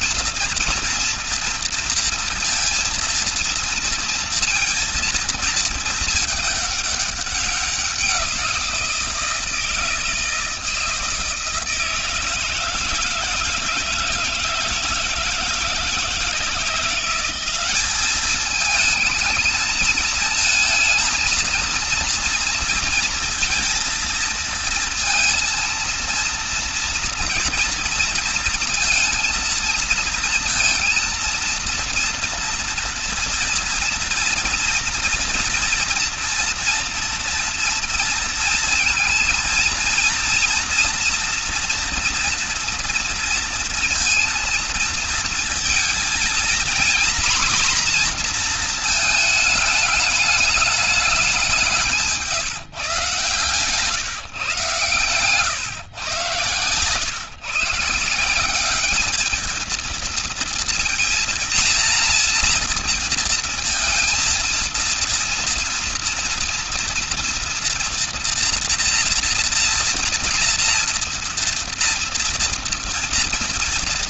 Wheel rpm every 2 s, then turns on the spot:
230, 230, 230, 210, 170, 160, 170, 160, 180, 220, 220, 230, 230, 230, 230, 230, 230, 230, 230, 230, 230, 240, 230, 230, 230, 210, 140, 140, 120, 200, 230, 230, 230, 230, 230, 230, 230.
none